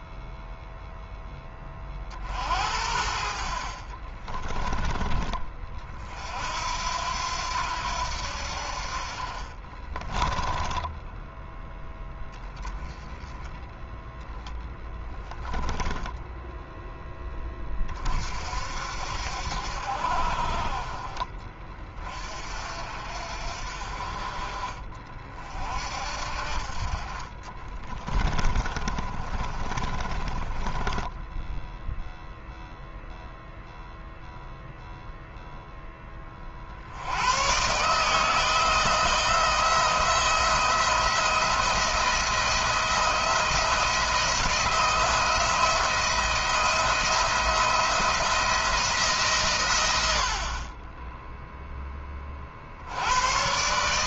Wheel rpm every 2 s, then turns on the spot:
0, 70, 20, 70, 50, 10, 10, 20, 10, 60, 40, 50, 40, 40, 40, 30, 0, 0, 60, 160, 170, 170, 170, 170, 160, 20, 80.
10-12 14-16 26-32